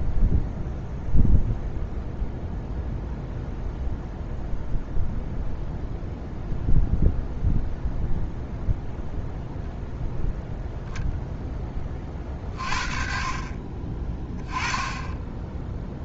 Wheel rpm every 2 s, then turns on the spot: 0, 0, 0, 0, 0, 0, 40, 20.
none